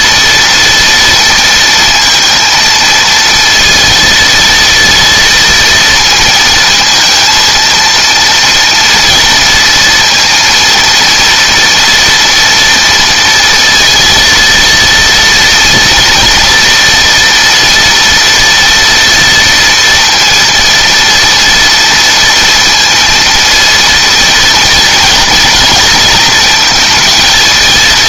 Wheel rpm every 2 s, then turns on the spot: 230, 230, 230, 230, 230, 230, 230, 230, 230, 230, 230, 230, 240, 230.
none